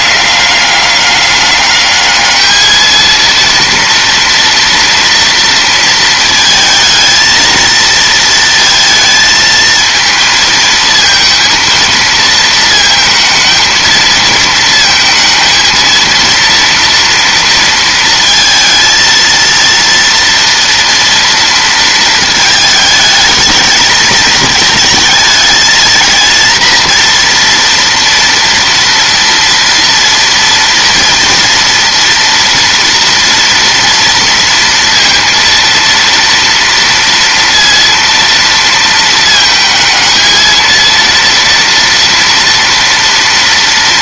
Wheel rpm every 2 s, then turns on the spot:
200, 220, 230, 220, 220, 220, 230, 220, 230, 230, 230, 220, 220, 230, 230, 230, 230, 230, 230, 220, 220, 230.
none